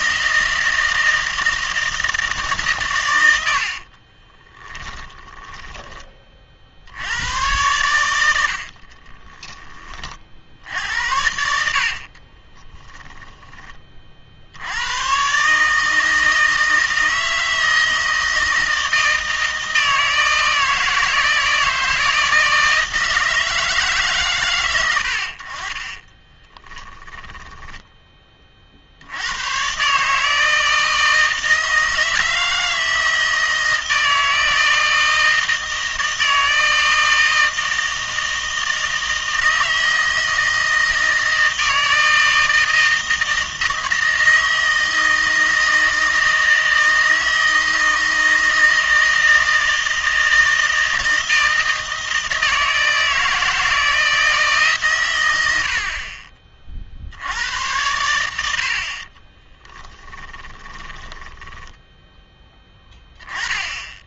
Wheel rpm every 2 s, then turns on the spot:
160, 130, 20, 60, 60, 70, 10, 100, 160, 160, 160, 160, 90, 20, 50, 160, 160, 160, 160, 160, 160, 160, 160, 160, 160, 160, 160, 140, 50, 60, 20, 10.
4-6 8-10 12-14 26-28 60-62